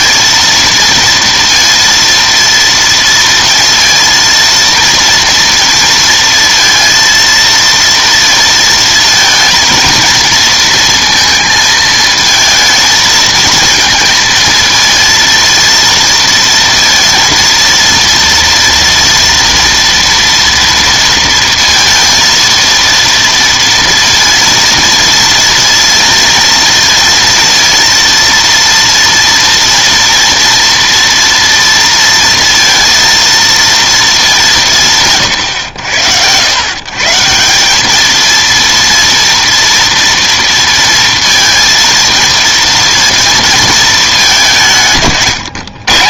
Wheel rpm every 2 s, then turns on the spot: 230, 230, 230, 230, 230, 230, 220, 230, 230, 230, 230, 230, 230, 230, 230, 230, 230, 190, 120, 230, 230, 230, 180.
none